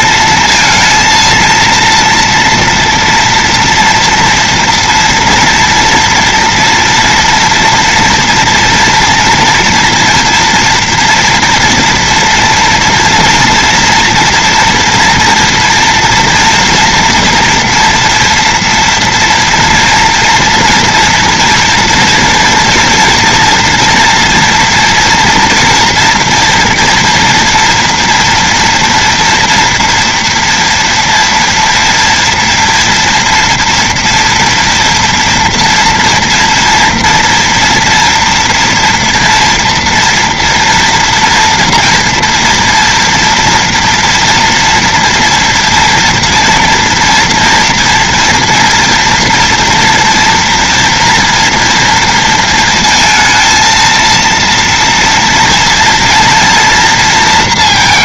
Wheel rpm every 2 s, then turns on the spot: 230, 230, 230, 230, 240, 230, 230, 230, 230, 230, 230, 230, 230, 230, 230, 230, 230, 230, 230, 240, 240, 240, 230, 230, 240, 230, 230, 230, 230.
none